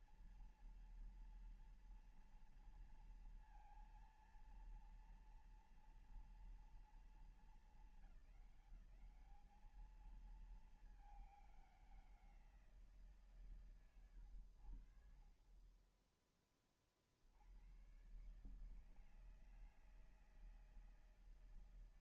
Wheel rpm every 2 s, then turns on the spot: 230, 230, 230, 230, 200, 220, 180, 90, 30, 140, 160.
none